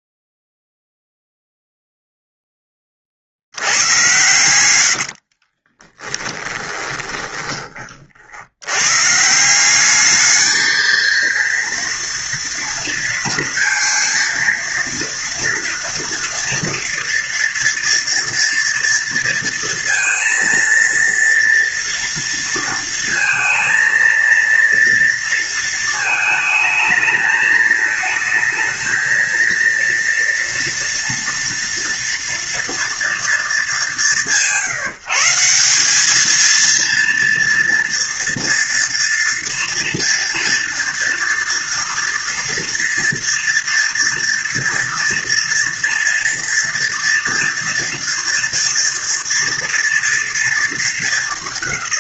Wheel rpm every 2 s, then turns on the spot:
0, 10, 90, 20, 80, 220, 230, 230, 230, 230, 230, 230, 230, 220, 220, 230, 230, 160, 230, 230, 230, 230, 230, 230, 240, 230.
4-8